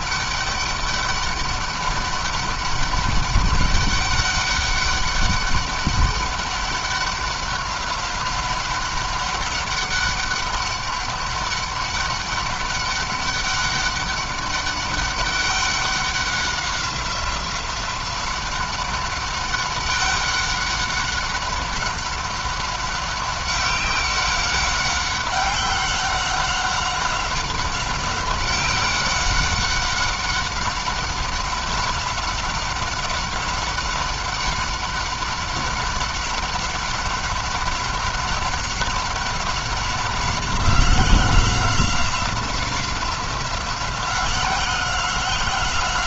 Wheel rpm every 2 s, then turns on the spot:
200, 200, 200, 190, 200, 200, 200, 200, 190, 190, 200, 200, 190, 190, 190, 190, 190, 190, 190, 190, 180, 180, 180.
none